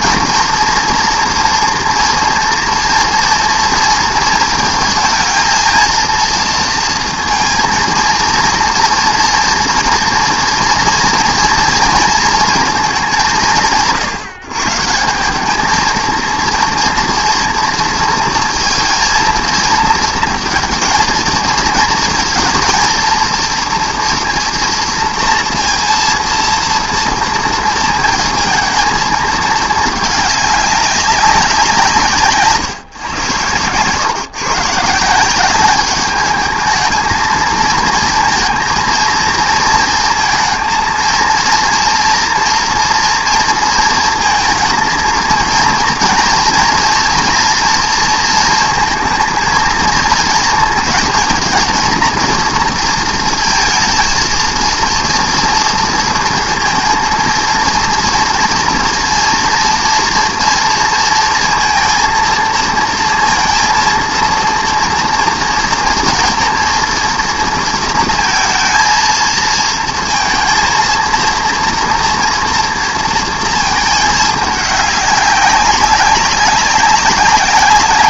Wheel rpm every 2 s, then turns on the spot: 230, 230, 230, 230, 240, 230, 200, 170, 230, 230, 230, 230, 230, 230, 230, 200, 120, 170, 220, 230, 230, 230, 230, 230, 230, 220, 230, 230, 230, 230, 230, 230, 230, 230, 220, 230, 230, 200, 190.
none